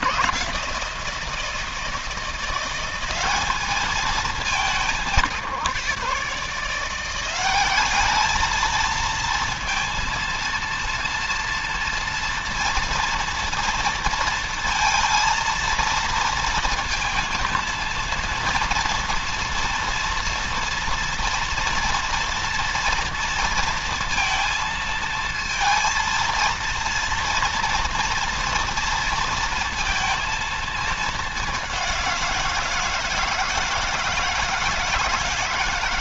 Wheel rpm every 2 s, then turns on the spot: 170, 180, 190, 170, 220, 230, 230, 230, 230, 230, 230, 230, 230, 230, 230, 220, 170, 170.
none